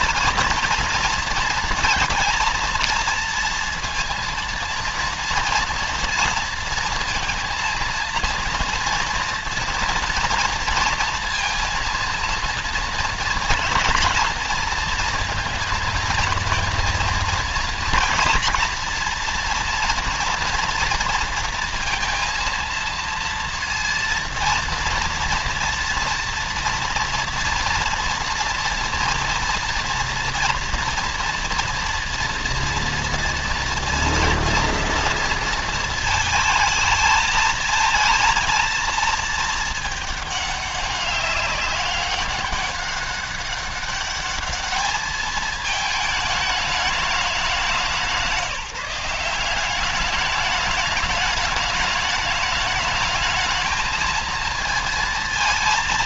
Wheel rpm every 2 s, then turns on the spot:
230, 230, 230, 230, 230, 230, 230, 230, 220, 230, 230, 230, 230, 230, 230, 230, 230, 230, 220, 230, 200, 200, 210, 210, 170, 210, 210, 220.
none